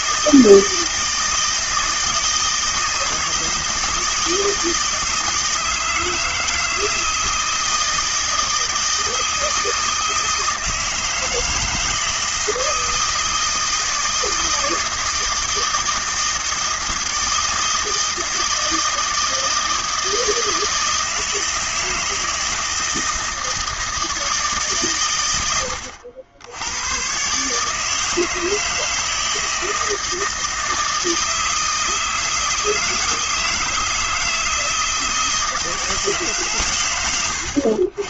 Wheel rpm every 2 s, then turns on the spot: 170, 160, 160, 160, 160, 160, 160, 160, 160, 160, 160, 160, 160, 90, 160, 160, 160, 160, 150.
none